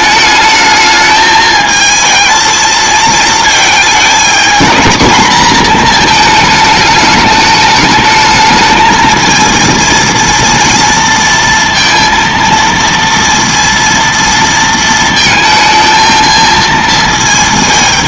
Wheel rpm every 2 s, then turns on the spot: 220, 220, 220, 220, 220, 230, 230, 230, 220.
none